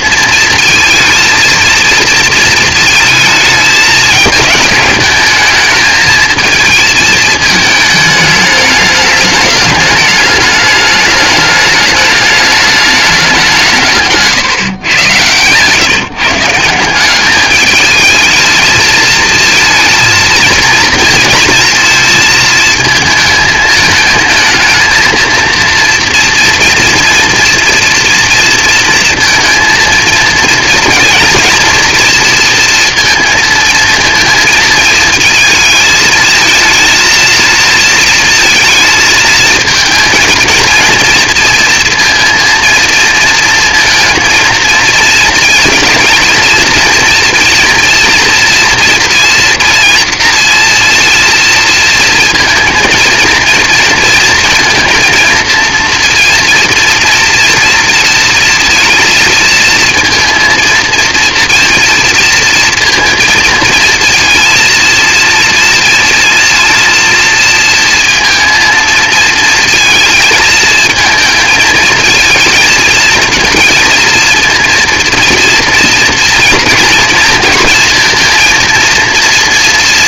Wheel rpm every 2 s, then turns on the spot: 230, 220, 220, 220, 210, 210, 180, 120, 200, 230, 220, 220, 230, 240, 230, 230, 230, 220, 230, 220, 230, 230, 230, 230, 230, 230, 230, 230, 230, 230, 230, 230, 230, 230, 230, 220, 230, 230, 230, 230.
none